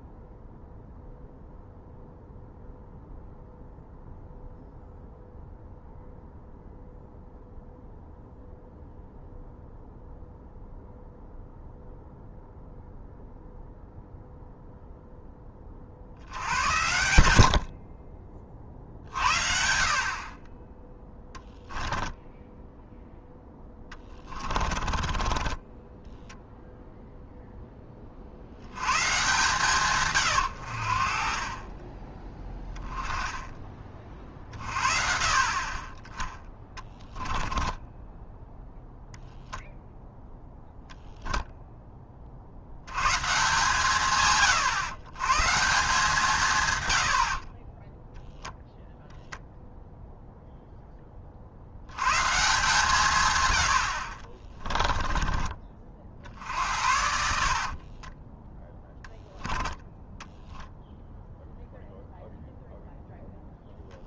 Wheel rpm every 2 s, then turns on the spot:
0, 0, 0, 0, 0, 0, 0, 0, 90, 50, 10, 0, 40, 0, 100, 60, 10, 50, 20, 0, 0, 100, 120, 110, 0, 10, 150, 20, 60, 10, 0, 0.
24-26 36-38 54-60